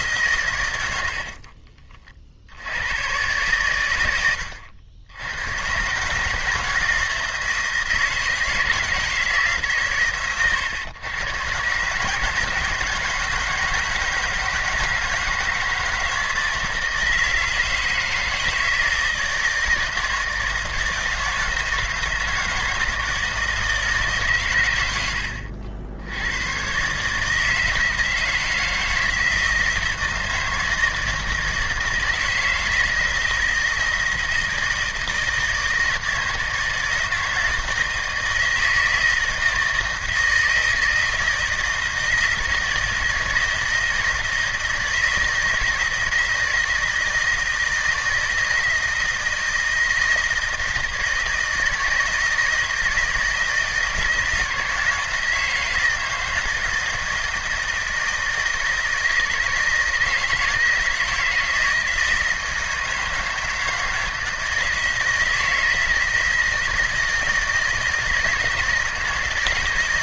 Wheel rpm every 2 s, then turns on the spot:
90, 90, 80, 160, 160, 120, 160, 170, 160, 160, 160, 160, 100, 130, 160, 160, 160, 160, 160, 160, 160, 160, 170, 160, 160, 160, 160, 160, 160, 160, 170, 160, 160, 160, 160.
none